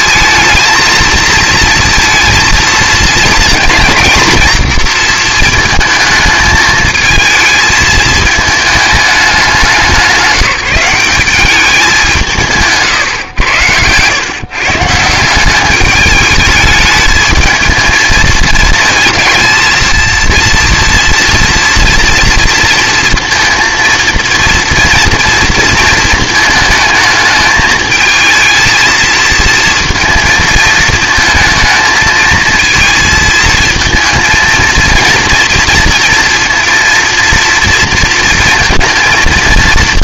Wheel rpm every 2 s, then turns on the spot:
230, 230, 230, 220, 220, 180, 170, 150, 210, 220, 230, 230, 230, 220, 230, 220, 230, 230, 230, 230.
none